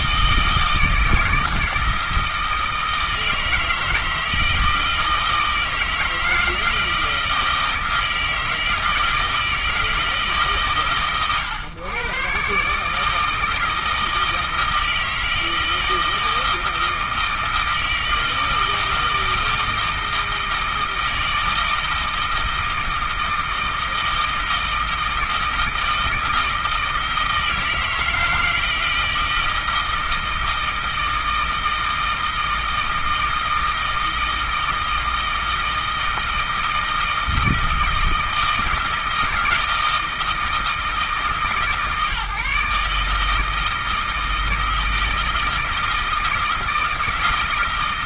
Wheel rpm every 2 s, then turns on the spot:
160, 160, 160, 160, 160, 130, 150, 160, 160, 160, 160, 160, 160, 160, 160, 160, 160, 160, 160, 160, 160, 150, 160, 160.
none